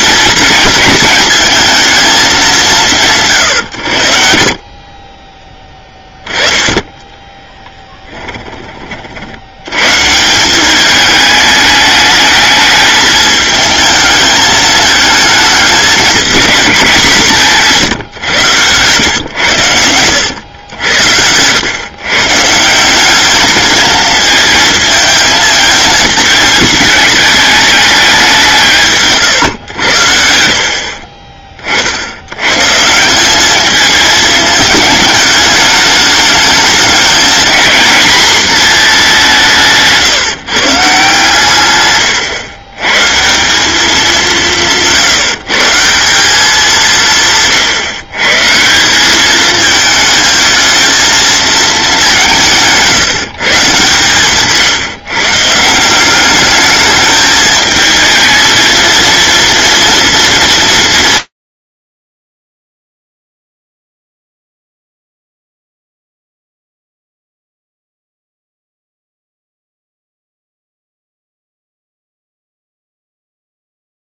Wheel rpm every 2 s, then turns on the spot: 220, 170, 40, 10, 30, 190, 220, 220, 200, 120, 100, 170, 220, 220, 160, 60, 140, 210, 210, 230, 150, 110, 180, 190, 160, 220, 170, 150, 210, 230, 200, 0, 0, 0, 0, 0, 0.
none